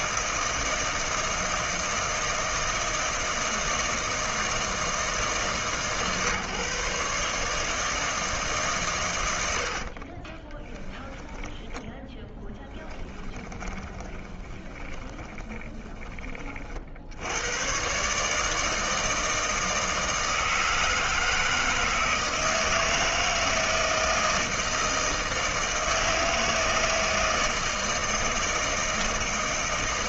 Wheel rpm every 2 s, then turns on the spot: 160, 160, 160, 140, 130, 10, 10, 20, 60, 160, 160, 160, 160, 160, 160.
12-16